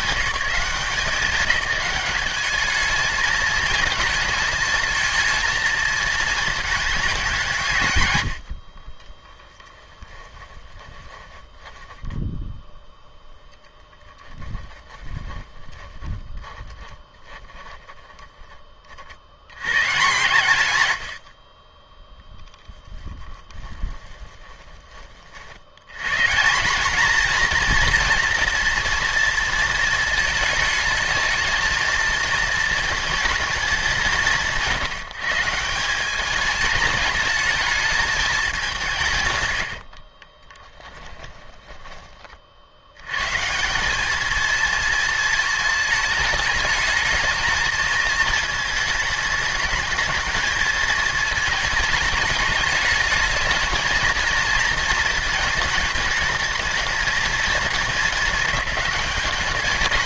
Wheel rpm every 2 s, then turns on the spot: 170, 210, 220, 210, 30, 20, 0, 10, 20, 10, 120, 10, 20, 210, 240, 220, 230, 150, 210, 170, 10, 80, 230, 220, 220, 220, 210, 230, 220, 220.
8-12 14-18 40-42